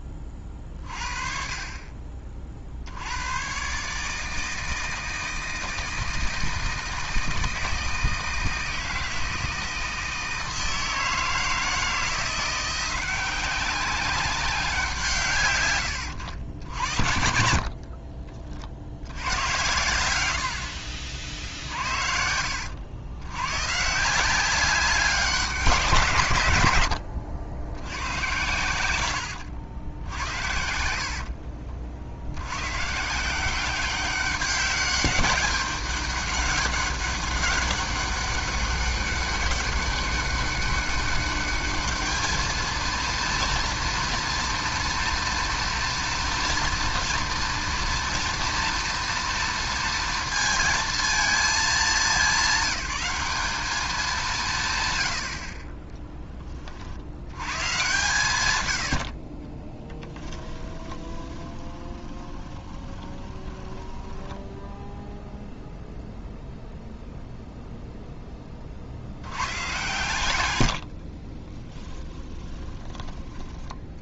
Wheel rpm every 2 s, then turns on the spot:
40, 60, 160, 160, 160, 160, 180, 180, 70, 70, 60, 80, 190, 110, 100, 60, 120, 200, 200, 200, 200, 230, 230, 230, 230, 230, 200, 130, 30, 90, 20, 20, 0, 0, 60, 80, 20.
26-28 30-32 60-64 70-74